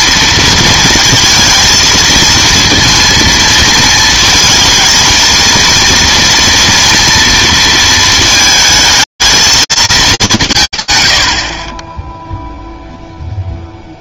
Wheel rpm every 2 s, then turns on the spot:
230, 230, 220, 230, 230, 180, 0.
none